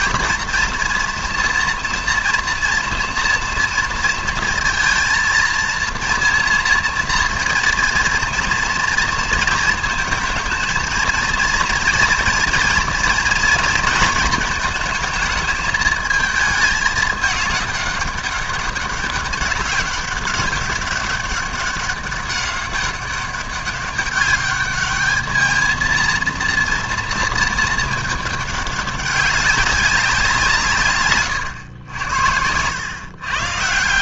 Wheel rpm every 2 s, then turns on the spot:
230, 230, 230, 230, 230, 220, 230, 220, 210, 200, 200, 200, 210, 230, 200, 150, 110.
none